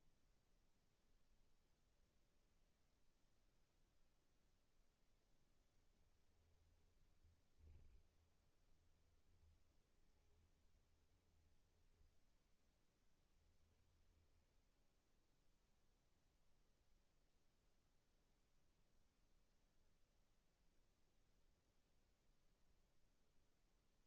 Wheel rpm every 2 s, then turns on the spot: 0, 0, 0, 20, 20, 20, 10, 0, 0, 0, 0, 0.
6-12